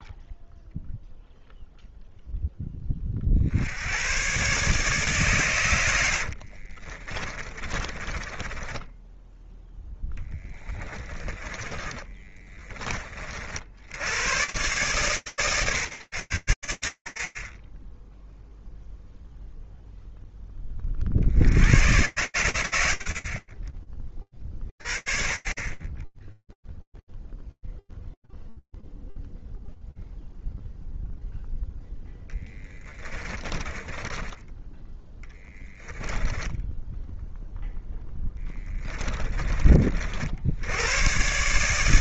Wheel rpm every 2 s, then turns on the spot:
0, 30, 140, 40, 10, 20, 20, 130, 90, 0, 40, 60, 50, 0, 0, 0, 10, 10, 0, 30, 130.
6-12 32-34 38-40